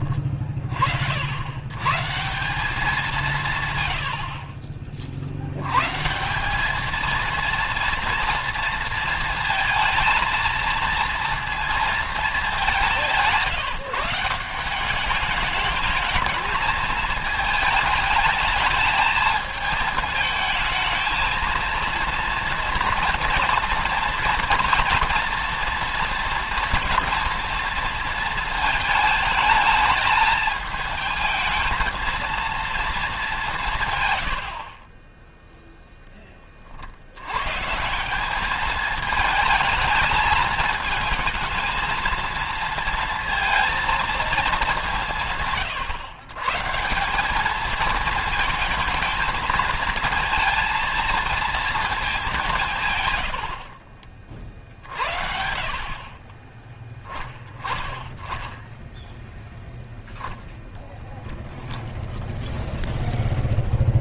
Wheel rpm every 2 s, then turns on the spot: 50, 180, 40, 220, 230, 230, 190, 180, 220, 210, 230, 240, 230, 230, 220, 220, 210, 30, 60, 220, 220, 230, 190, 180, 220, 220, 140, 50, 10, 0, 0, 0.
34-36